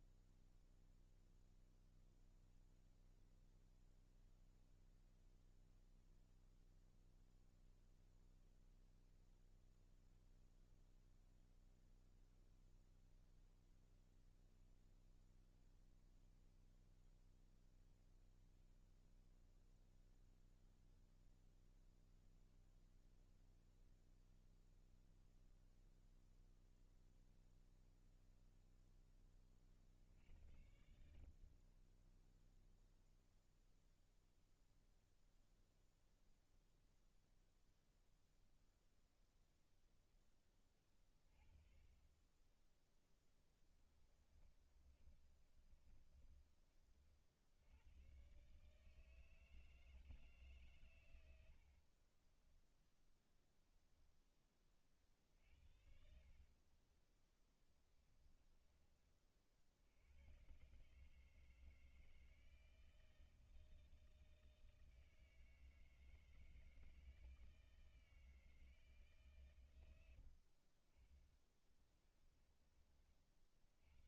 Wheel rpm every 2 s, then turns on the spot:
0, 0, 0, 0, 0, 0, 0, 0, 0, 0, 0, 0, 0, 0, 10, 60, 0, 0, 0, 0, 20, 10, 30, 50, 160, 100, 0, 40, 20, 40, 150, 160, 160, 160, 140, 30, 30.
42-46 50-52 54-58 70-72